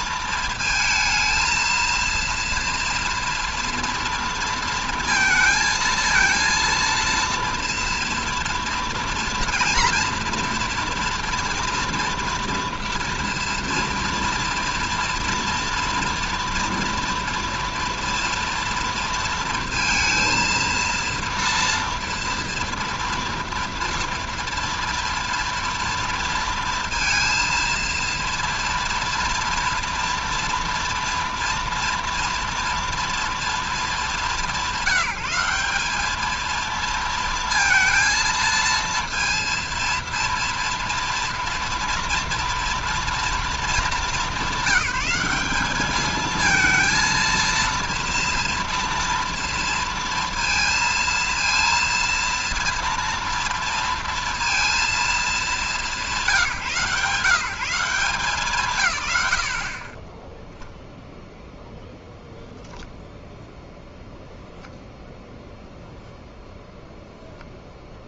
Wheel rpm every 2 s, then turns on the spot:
230, 230, 230, 230, 230, 230, 230, 230, 230, 230, 230, 230, 230, 230, 230, 230, 230, 180, 220, 230, 230, 230, 200, 220, 230, 230, 230, 230, 170, 160, 0, 0, 0, 0.
none